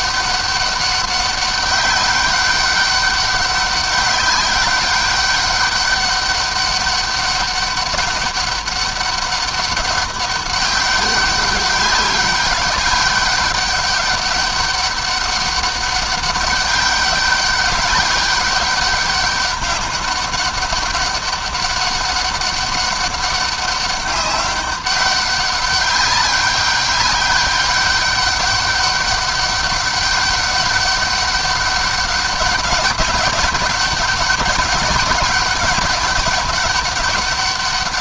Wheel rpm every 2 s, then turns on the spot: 200, 200, 200, 200, 200, 200, 200, 200, 200, 200, 200, 200, 200, 200, 200, 200, 200, 200, 200.
none